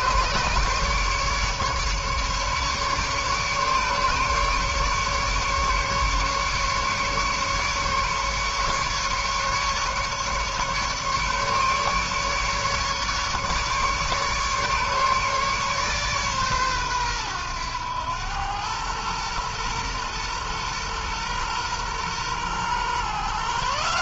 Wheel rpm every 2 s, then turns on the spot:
150, 140, 150, 150, 150, 150, 150, 150, 120, 110, 120, 130.
none